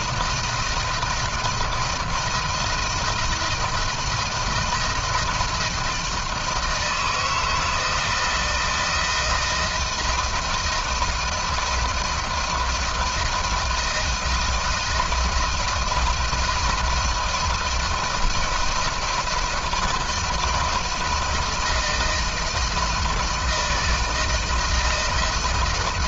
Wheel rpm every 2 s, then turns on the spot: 160, 170, 160, 160, 160, 160, 160, 170, 160, 160, 170, 160, 170.
none